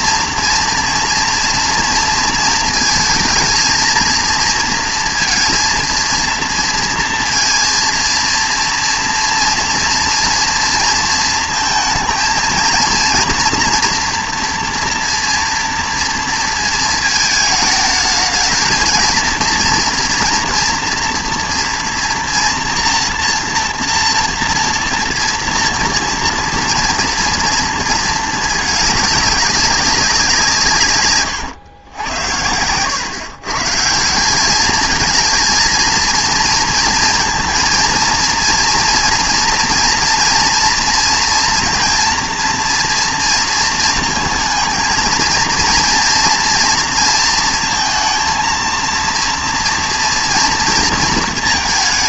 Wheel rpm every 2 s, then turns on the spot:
230, 220, 230, 230, 230, 230, 230, 230, 220, 220, 240, 230, 230, 230, 210, 150, 100, 210, 230, 230, 230, 230, 220, 230, 230, 230.
none